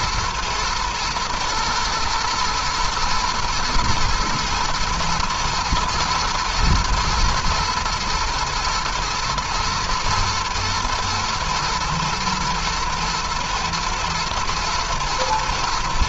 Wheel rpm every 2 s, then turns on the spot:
110, 120, 120, 120, 120, 120, 120, 120.
none